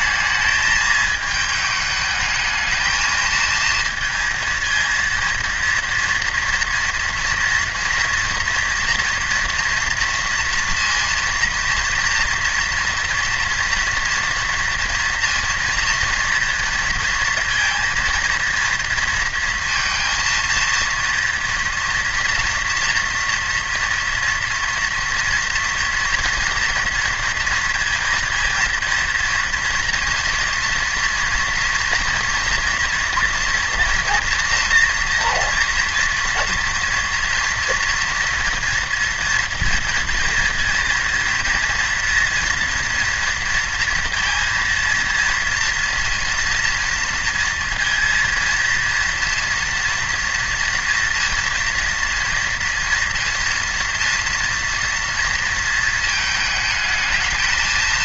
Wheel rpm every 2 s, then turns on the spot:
220, 220, 220, 230, 230, 230, 230, 230, 230, 230, 230, 230, 240, 230, 230, 230, 230, 230, 230, 230, 220, 230, 230, 230, 240, 230, 240, 230, 220.
none